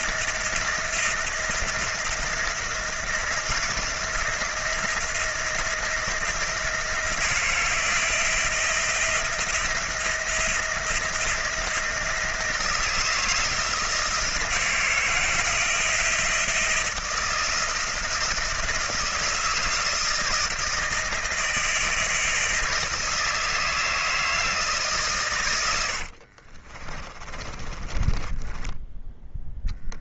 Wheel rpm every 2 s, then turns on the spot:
160, 160, 170, 170, 160, 170, 170, 160, 160, 160, 160, 160, 140, 40, 10.
26-30